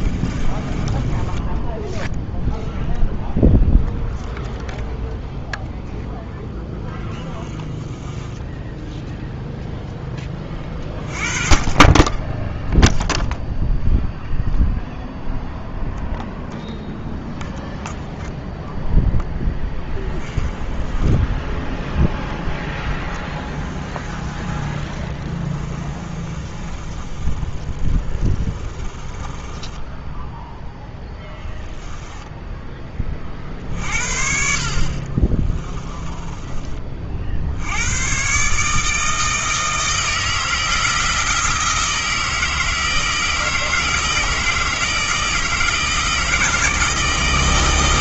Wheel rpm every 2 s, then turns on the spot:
20, 0, 0, 10, 10, 20, 0, 0, 0, 0, 10, 10, 20, 30, 20, 0, 20, 40, 30, 150, 160, 160, 160, 160.
0-2 6-10 20-30